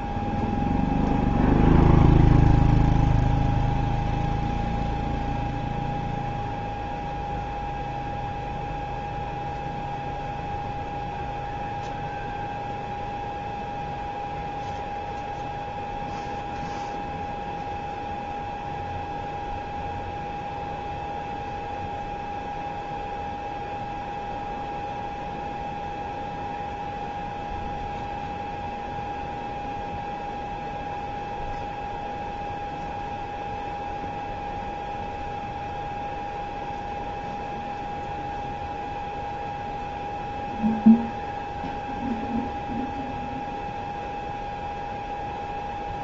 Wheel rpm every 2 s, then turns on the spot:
0, 0, 0, 0, 0, 0, 0, 0, 0, 0, 0, 0, 0, 0, 0, 0, 0, 0, 0, 0, 0, 0, 0.
none